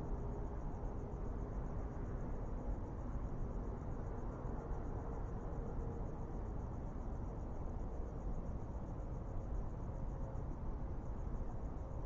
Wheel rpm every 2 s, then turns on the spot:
0, 0, 0, 0, 0, 0.
none